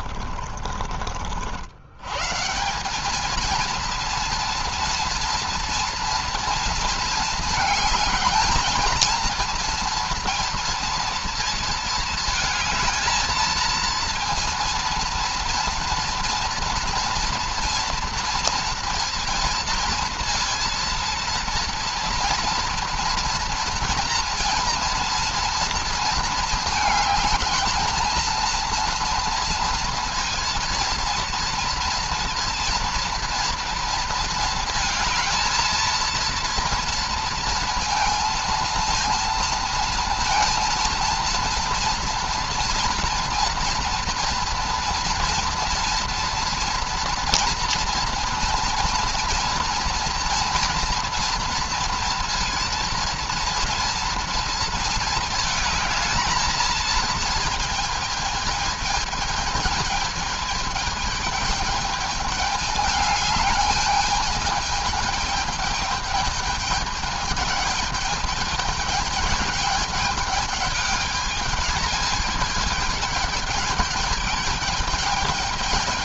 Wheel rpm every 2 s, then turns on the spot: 40, 160, 230, 230, 220, 230, 230, 230, 230, 230, 230, 230, 230, 220, 230, 230, 230, 220, 230, 230, 230, 240, 230, 230, 230, 230, 230, 220, 220, 220, 220, 210, 210, 210, 220, 210, 210, 210.
0-2